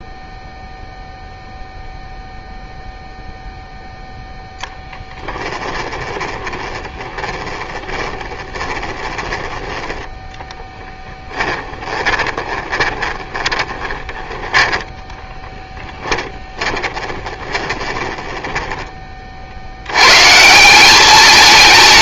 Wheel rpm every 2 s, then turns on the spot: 0, 0, 10, 20, 10, 10, 20, 10, 20, 20, 190.
4-14 16-18